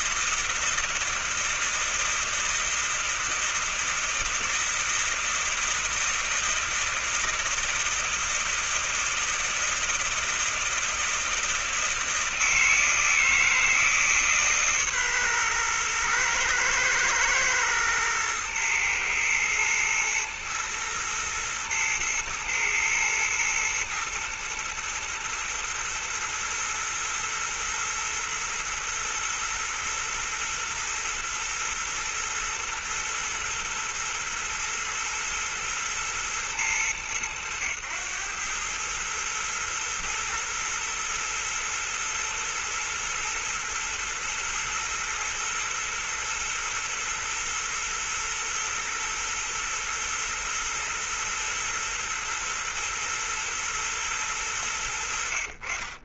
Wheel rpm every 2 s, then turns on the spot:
160, 160, 160, 160, 160, 160, 160, 150, 110, 110, 110, 110, 110, 110, 110, 110, 110, 120, 110, 100, 110, 110, 110, 110, 110, 110, 120, 100.
none